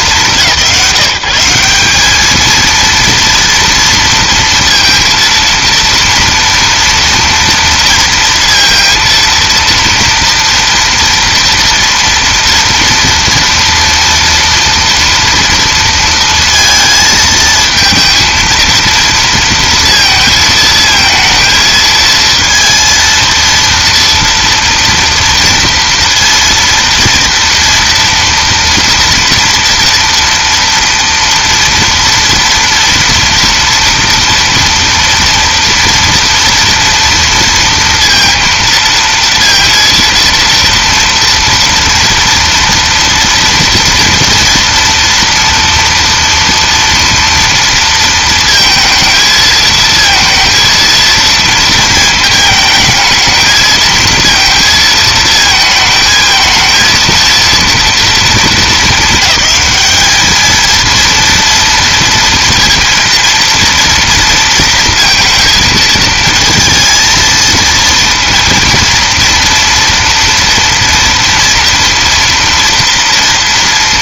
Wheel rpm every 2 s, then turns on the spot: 170, 230, 230, 230, 230, 230, 230, 230, 220, 230, 220, 230, 230, 230, 230, 230, 230, 230, 230, 230, 230, 230, 230, 230, 220, 230, 220, 230, 230, 220, 230, 230, 230, 230, 230, 230, 230.
none